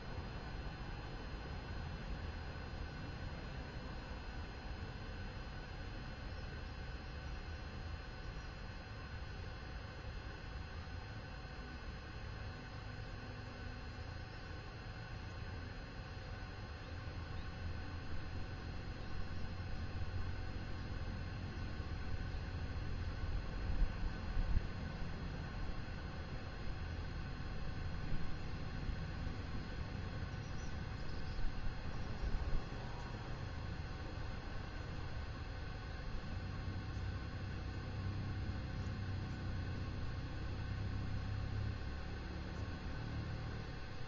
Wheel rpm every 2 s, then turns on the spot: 0, 0, 0, 0, 0, 0, 0, 0, 0, 0, 0, 0, 0, 0, 0, 0, 0, 0, 0, 0, 0, 0.
none